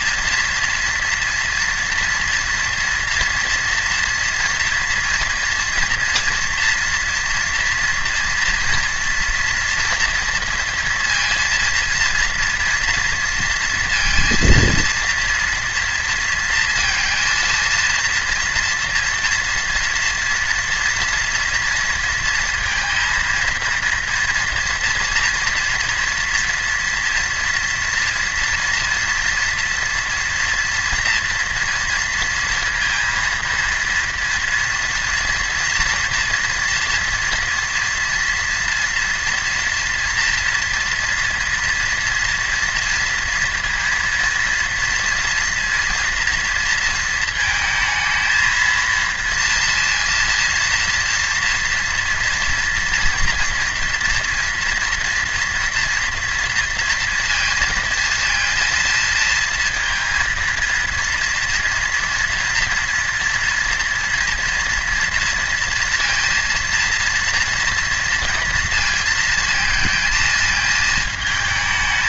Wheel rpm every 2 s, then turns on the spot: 230, 230, 240, 230, 230, 230, 230, 230, 230, 230, 230, 230, 230, 230, 230, 230, 230, 230, 240, 240, 230, 230, 230, 230, 220, 230, 230, 230, 230, 230, 230, 240, 230, 230, 230, 220.
none